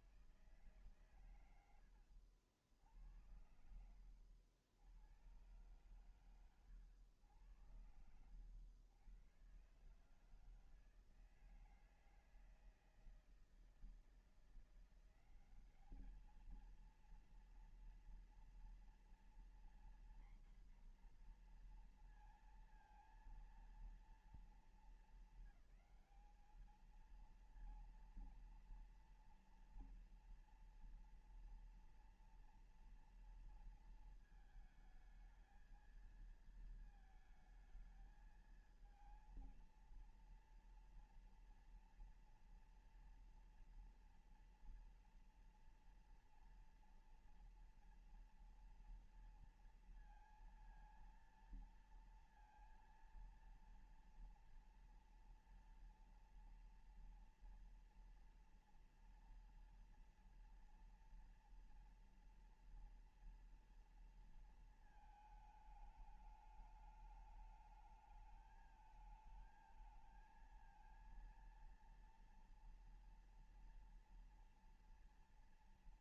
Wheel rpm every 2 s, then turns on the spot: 160, 80, 80, 120, 90, 140, 160, 160, 210, 240, 250, 230, 220, 200, 230, 230, 230, 220, 220, 220, 230, 230, 230, 230, 230, 230, 230, 230, 230, 230, 230, 230, 230, 210, 220, 220, 230, 230.
none